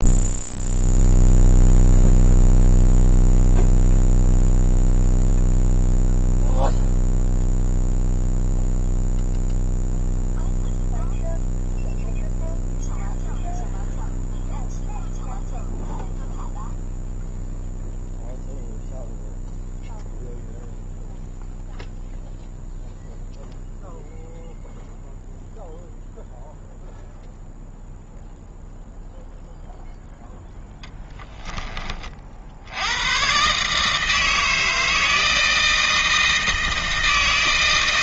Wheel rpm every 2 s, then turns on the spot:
0, 0, 0, 0, 0, 0, 0, 0, 0, 0, 0, 0, 0, 0, 0, 10, 80, 160, 160.
none